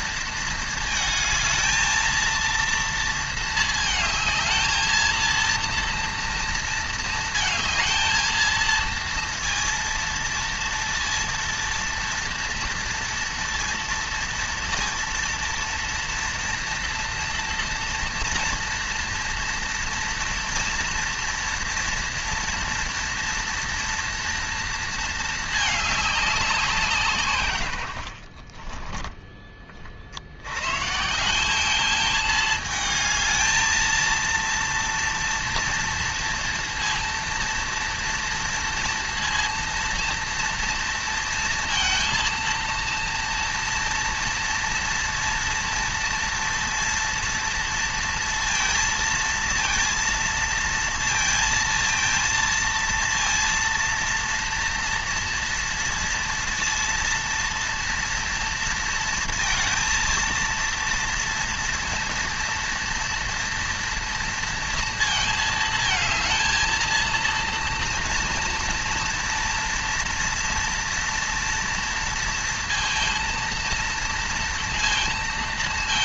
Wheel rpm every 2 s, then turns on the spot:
220, 220, 230, 220, 230, 230, 230, 230, 230, 230, 230, 230, 220, 150, 20, 170, 220, 230, 230, 230, 230, 230, 230, 230, 230, 230, 230, 230, 230, 230, 230, 230, 220, 230, 230, 230, 230, 230.
none